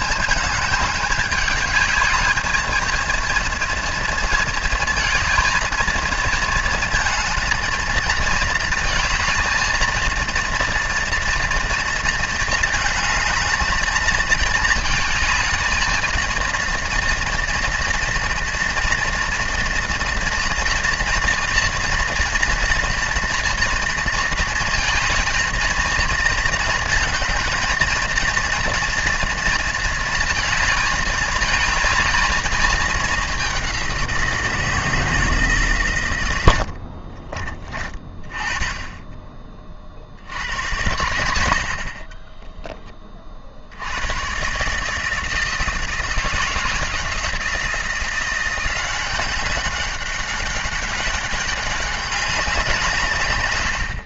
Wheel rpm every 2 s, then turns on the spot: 210, 230, 230, 230, 230, 230, 230, 220, 230, 230, 240, 240, 230, 220, 240, 220, 210, 160, 60, 20, 100, 20, 150, 160, 180, 190, 160.
36-38